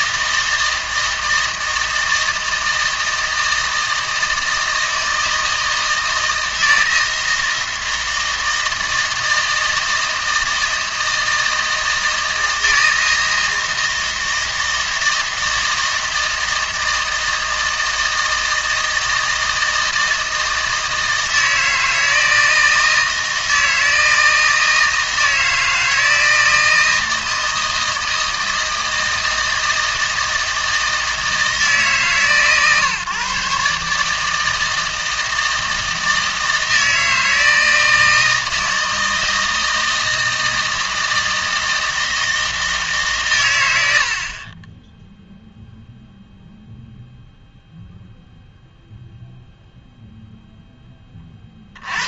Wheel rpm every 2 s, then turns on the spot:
160, 160, 160, 160, 160, 160, 160, 160, 160, 160, 160, 160, 160, 160, 160, 160, 140, 160, 160, 160, 160, 150, 20, 0, 0, 10.
none